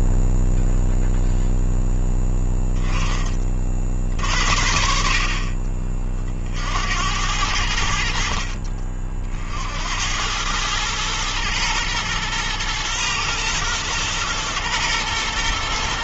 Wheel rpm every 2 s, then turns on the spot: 0, 20, 50, 80, 60, 110, 110, 120.
none